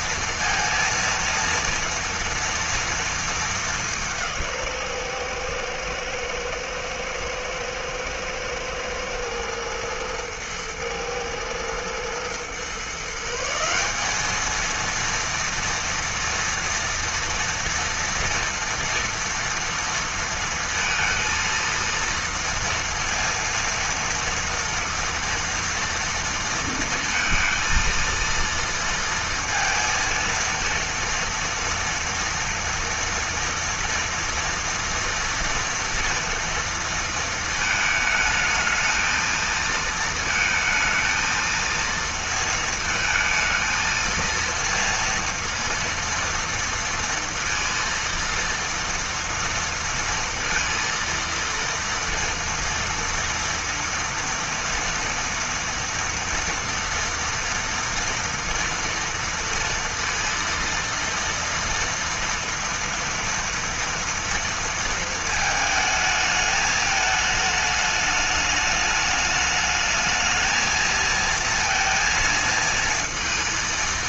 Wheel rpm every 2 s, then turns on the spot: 230, 230, 130, 110, 120, 110, 140, 230, 230, 230, 230, 230, 230, 230, 230, 230, 230, 230, 230, 220, 230, 220, 230, 230, 230, 230, 230, 230, 230, 230, 230, 240, 230, 210, 210, 230, 230.
none